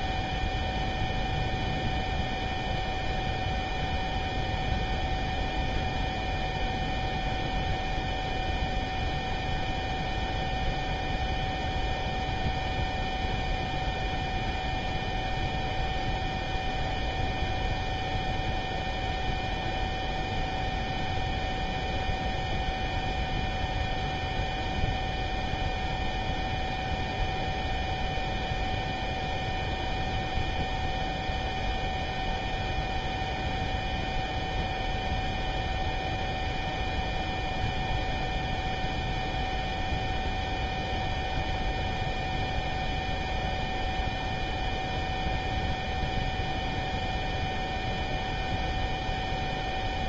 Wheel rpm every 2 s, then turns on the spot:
0, 0, 0, 0, 0, 0, 0, 0, 0, 0, 0, 0, 0, 0, 0, 0, 0, 0, 0, 0, 0, 0, 0, 0, 0.
none